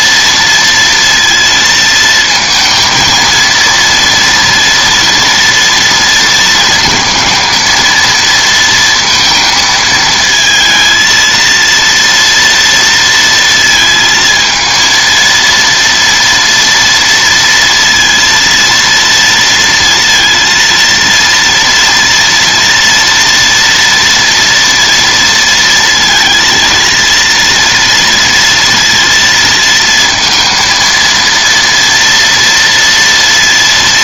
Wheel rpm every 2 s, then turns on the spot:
230, 220, 230, 230, 230, 230, 230, 230, 230, 230, 230, 230, 230, 230, 230, 230, 230.
none